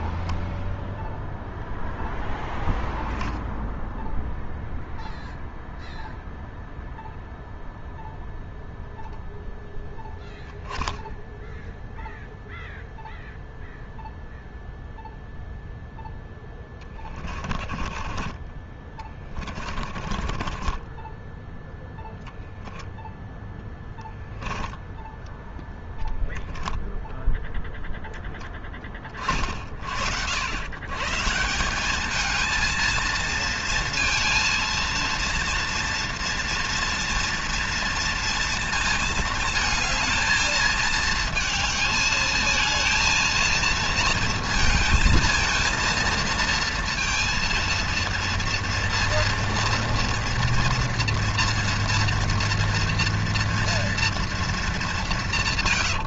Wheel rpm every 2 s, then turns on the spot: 0, 0, 0, 0, 0, 10, 0, 0, 10, 20, 20, 20, 10, 0, 10, 110, 220, 230, 230, 230, 220, 220, 220, 230, 230, 230, 230, 210.
16-22 24-26